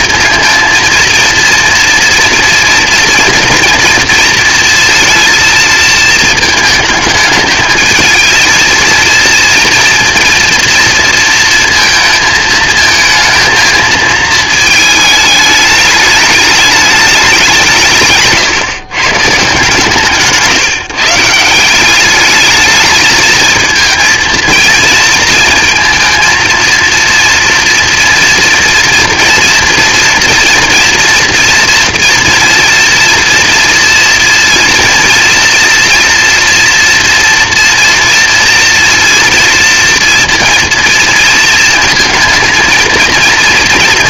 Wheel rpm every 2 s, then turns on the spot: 230, 230, 230, 220, 220, 230, 220, 220, 210, 140, 150, 210, 230, 230, 240, 240, 230, 230, 230, 230, 230, 230.
none